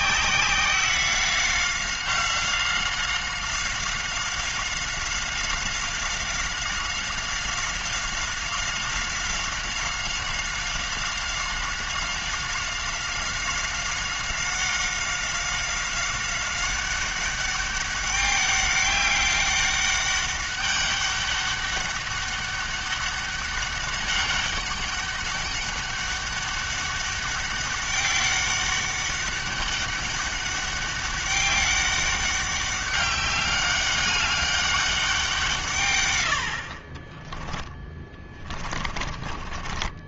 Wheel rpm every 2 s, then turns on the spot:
190, 190, 190, 190, 190, 190, 190, 190, 190, 200, 200, 200, 200, 200, 200, 200, 200, 200, 40, 30.
36-38